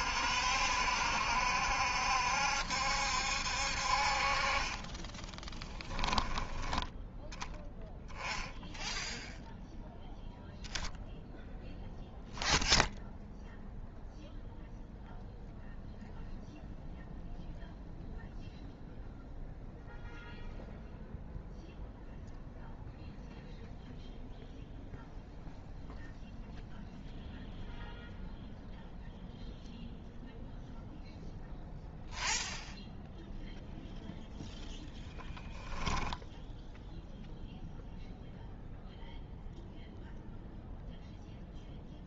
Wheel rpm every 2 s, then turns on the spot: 70, 70, 20, 10, 0, 0, 0, 0, 0, 0, 0, 0, 0, 0, 0, 0, 0, 0, 0, 0, 0.
none